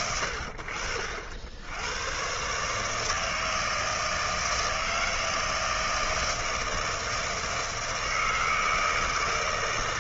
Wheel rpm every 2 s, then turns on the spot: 70, 160, 160, 160, 150.
none